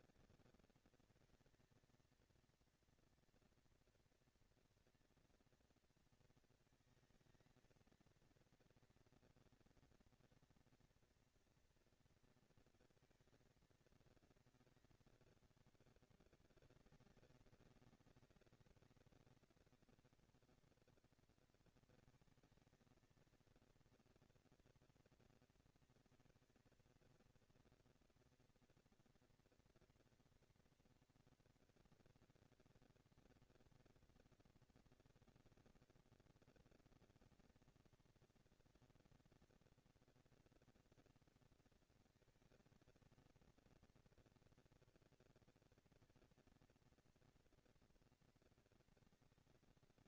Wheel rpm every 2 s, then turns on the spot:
230, 230, 230, 230, 230, 230, 230, 220, 200, 190, 210, 220, 230, 230, 230, 230, 230, 230, 230, 230, 230, 230, 230, 230, 220.
none